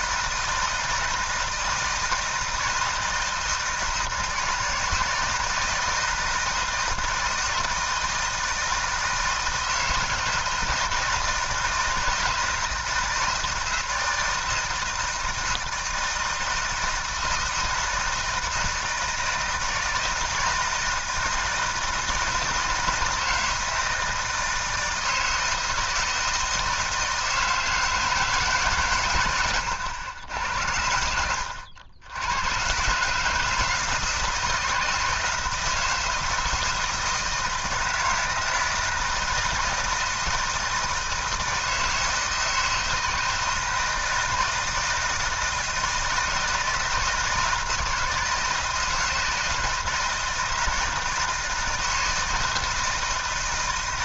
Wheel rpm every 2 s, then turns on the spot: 160, 160, 160, 160, 160, 160, 170, 160, 160, 160, 160, 160, 160, 160, 140, 80, 110, 160, 160, 160, 160, 160, 160, 160, 160, 160, 160.
none